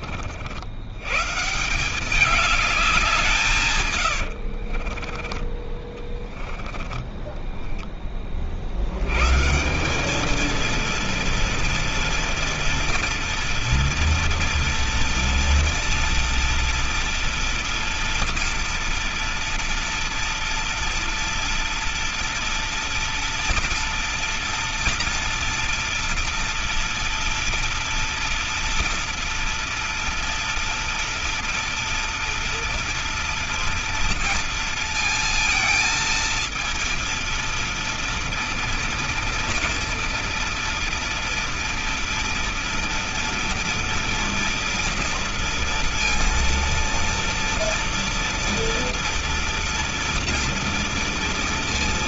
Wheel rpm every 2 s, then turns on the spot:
80, 190, 60, 20, 60, 230, 230, 230, 230, 230, 230, 230, 240, 230, 230, 230, 230, 230, 230, 230, 230, 230, 230, 230, 230, 230.
4-6